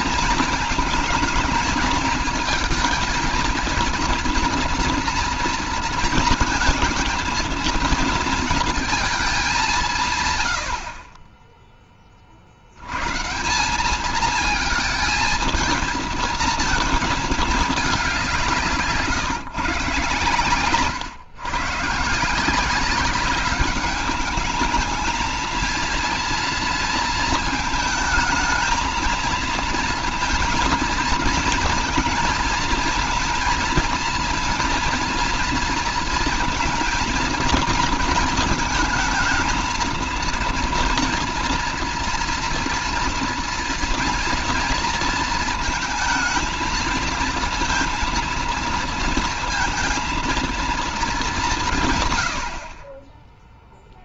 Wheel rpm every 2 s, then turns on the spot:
230, 220, 230, 230, 230, 100, 70, 220, 230, 170, 130, 180, 210, 230, 220, 230, 230, 230, 230, 230, 230, 240, 230, 220, 230, 230, 80.
none